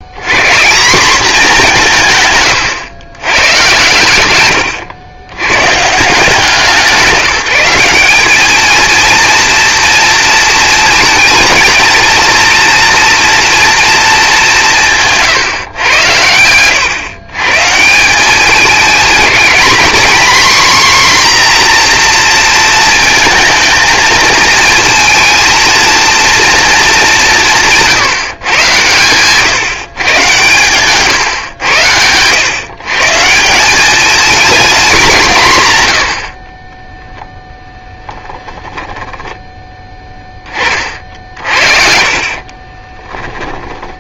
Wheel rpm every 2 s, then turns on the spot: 220, 110, 90, 180, 230, 230, 230, 150, 120, 230, 260, 230, 230, 200, 120, 130, 150, 200, 10, 10, 40, 20.
36-40 42-44